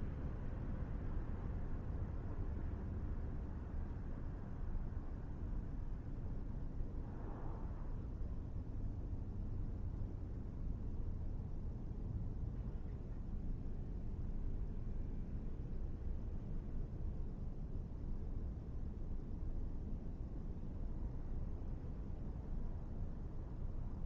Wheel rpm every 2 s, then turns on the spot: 0, 0, 0, 0, 0, 0, 0, 0, 0, 0, 0, 0.
none